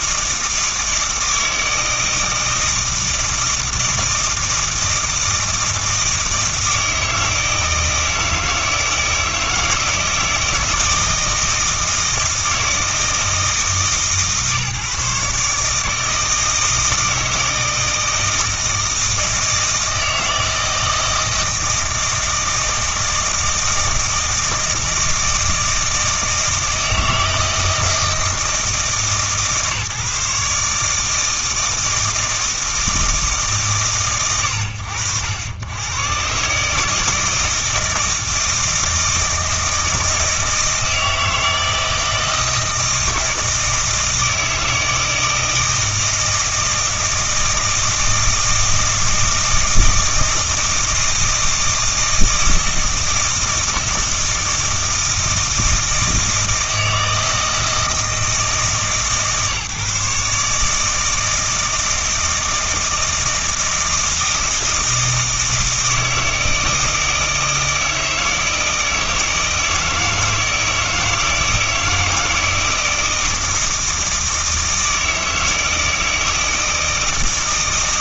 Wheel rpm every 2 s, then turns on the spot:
160, 160, 160, 160, 160, 160, 160, 140, 160, 160, 160, 160, 160, 160, 160, 150, 160, 90, 130, 160, 160, 160, 160, 160, 160, 160, 160, 160, 160, 150, 150, 160, 160, 160, 160, 160, 170, 160, 160.
none